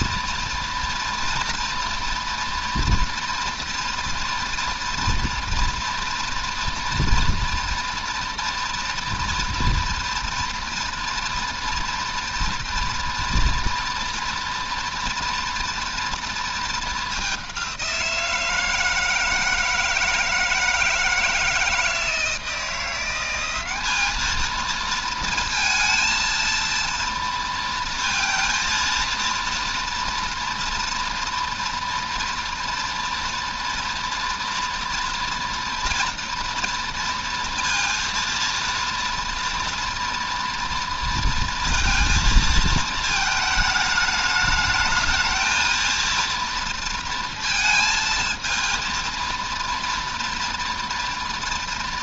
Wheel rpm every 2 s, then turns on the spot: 240, 230, 240, 230, 240, 240, 240, 230, 220, 160, 160, 170, 230, 230, 230, 230, 230, 230, 230, 230, 230, 230, 210, 230, 230, 230.
none